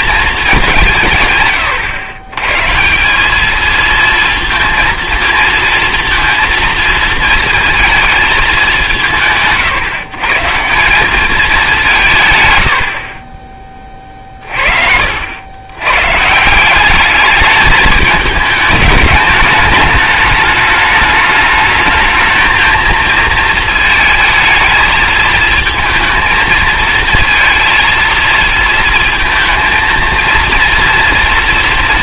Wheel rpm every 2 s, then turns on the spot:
180, 160, 230, 230, 200, 170, 100, 60, 190, 210, 210, 220, 220, 220, 220, 230.
14-16